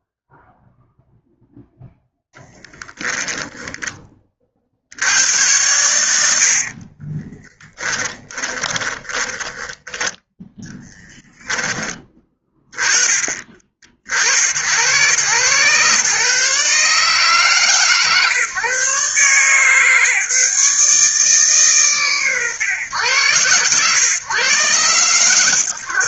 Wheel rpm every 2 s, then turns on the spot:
0, 10, 60, 60, 20, 10, 20, 80, 140, 140, 150, 120, 130.
2-4 6-10